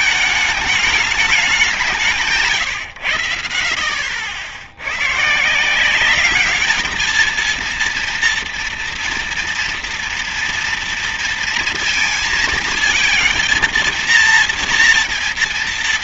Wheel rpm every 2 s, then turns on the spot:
210, 130, 80, 210, 230, 230, 230, 230.
none